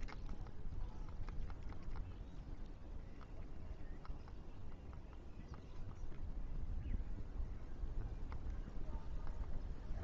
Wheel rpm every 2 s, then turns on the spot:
0, 0, 0, 0, 0.
none